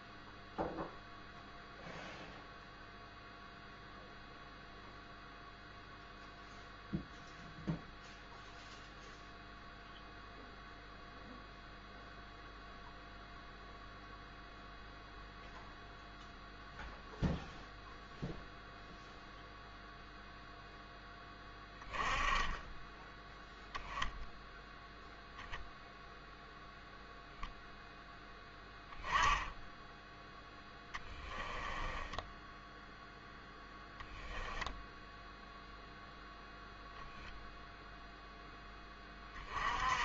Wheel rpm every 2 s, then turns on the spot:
0, 0, 0, 0, 0, 0, 0, 0, 0, 0, 0, 10, 0, 0, 10, 20, 0, 0, 0, 10.
30-32